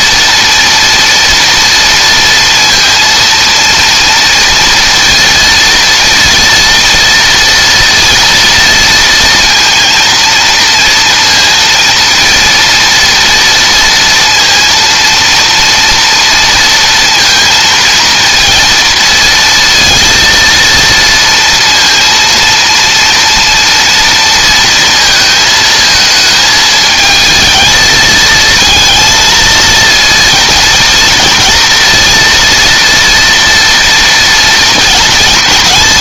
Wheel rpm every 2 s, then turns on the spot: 230, 230, 230, 230, 230, 230, 230, 230, 230, 230, 230, 230, 230, 220, 230, 230, 230, 230.
none